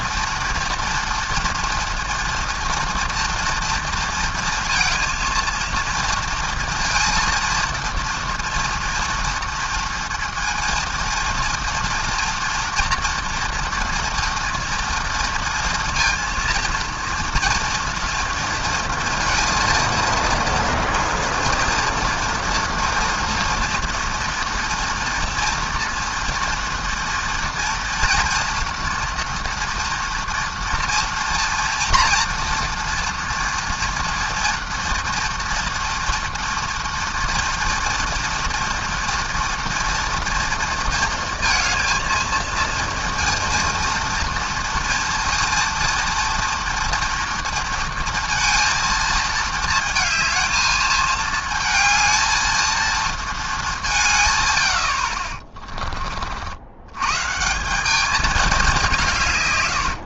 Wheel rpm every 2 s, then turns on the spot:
230, 240, 220, 230, 230, 230, 230, 230, 230, 230, 230, 240, 230, 230, 230, 230, 230, 230, 230, 230, 230, 230, 230, 230, 220, 220, 220, 80, 90, 190.
none